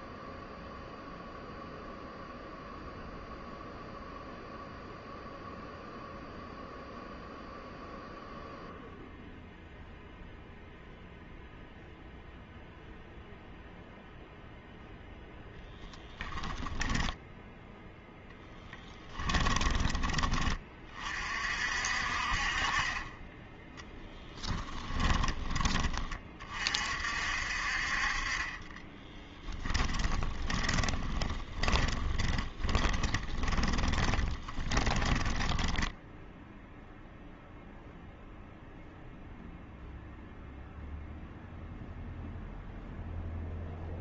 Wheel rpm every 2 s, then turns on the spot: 0, 0, 0, 0, 0, 0, 0, 10, 10, 10, 40, 20, 10, 50, 20, 20, 20, 10, 0, 0, 0, 0.
16-20 24-26 28-36